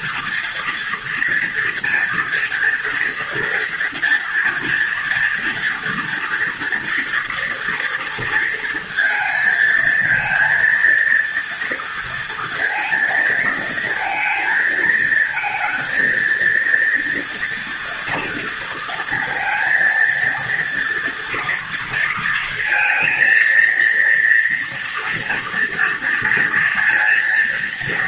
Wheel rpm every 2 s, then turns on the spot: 230, 230, 240, 230, 230, 230, 230, 220, 230, 230, 230, 230, 230, 230.
none